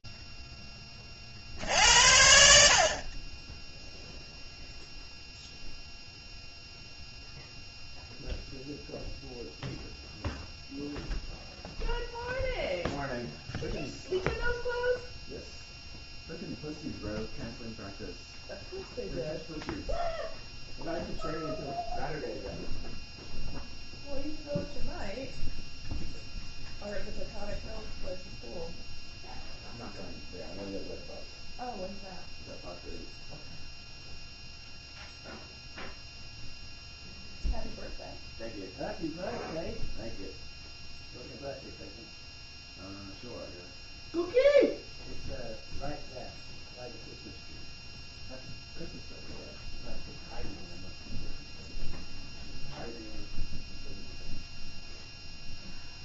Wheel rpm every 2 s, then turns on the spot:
10, 70, 0, 0, 0, 0, 0, 0, 0, 0, 0, 0, 0, 0, 0, 0, 0, 0, 0, 0, 0, 0, 0, 0, 0, 0, 0, 0.
none